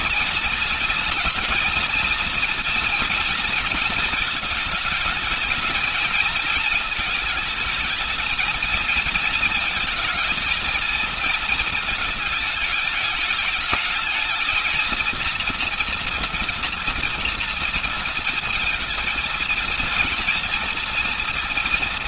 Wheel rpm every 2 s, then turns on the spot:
240, 230, 210, 220, 220, 220, 210, 230, 230, 230, 230.
none